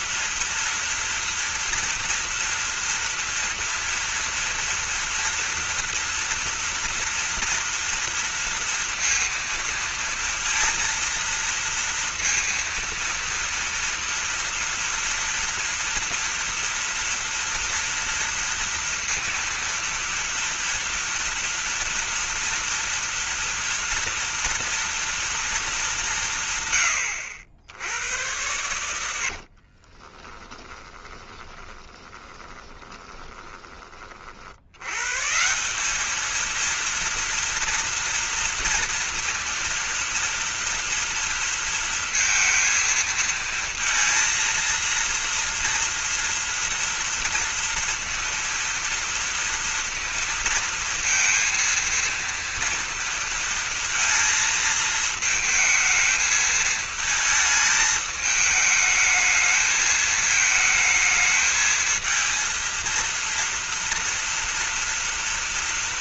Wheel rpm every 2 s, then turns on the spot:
230, 240, 230, 230, 230, 230, 230, 230, 240, 230, 230, 230, 230, 70, 90, 20, 20, 120, 230, 230, 230, 230, 230, 230, 230, 230, 230, 220, 220, 220, 220, 230, 230.
28-34